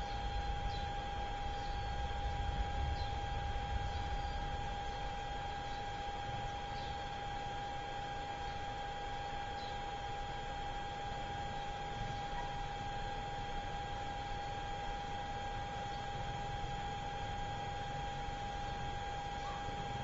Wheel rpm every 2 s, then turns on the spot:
0, 0, 0, 0, 0, 0, 0, 0, 0, 0.
none